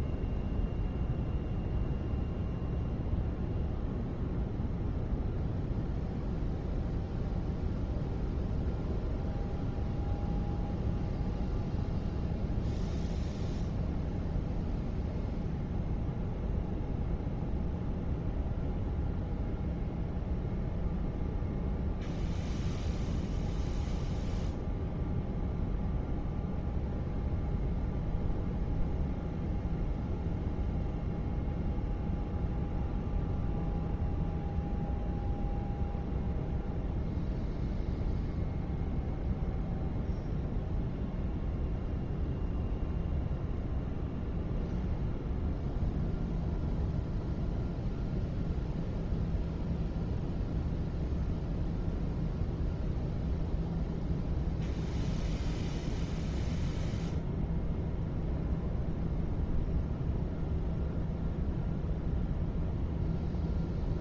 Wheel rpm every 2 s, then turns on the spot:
0, 0, 0, 0, 0, 0, 0, 0, 0, 0, 0, 0, 0, 0, 0, 0, 0, 0, 0, 0, 0, 0, 0, 0, 0, 0, 0, 0, 0, 0, 0, 0.
none